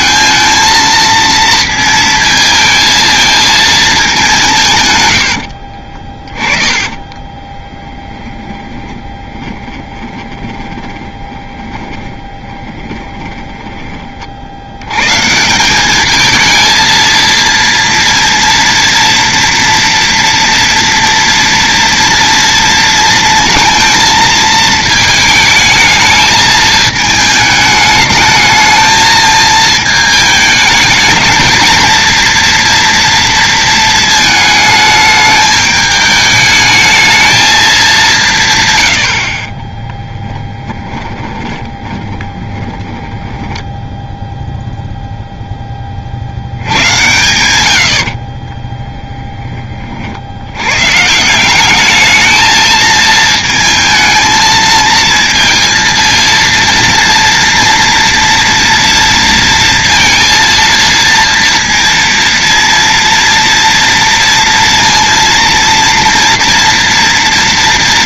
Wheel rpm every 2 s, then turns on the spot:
230, 230, 160, 20, 20, 30, 10, 90, 230, 230, 230, 230, 220, 220, 220, 210, 230, 220, 220, 130, 10, 20, 0, 100, 30, 110, 220, 220, 230, 230, 230, 230, 230, 230.
6-14 40-44 48-50